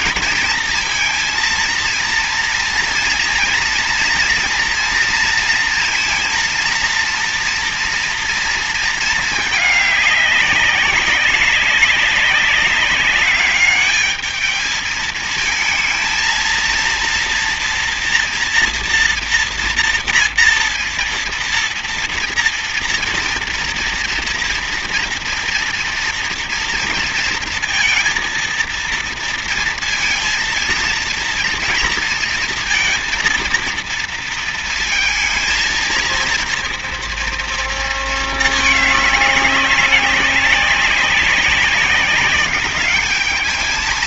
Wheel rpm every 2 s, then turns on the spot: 230, 230, 230, 230, 220, 200, 200, 220, 230, 230, 230, 230, 230, 230, 230, 230, 230, 230, 230, 210, 190, 200.
none